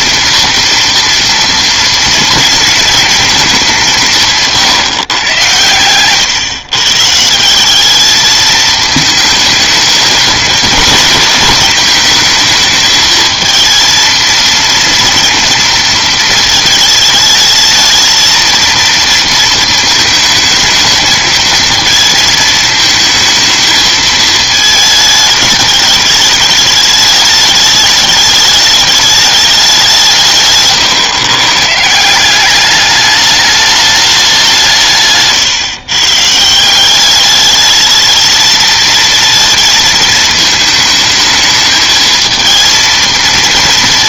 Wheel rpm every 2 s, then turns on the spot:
230, 230, 150, 130, 220, 220, 220, 230, 220, 230, 220, 220, 220, 210, 210, 140, 200, 180, 160, 220, 220, 230.
30-32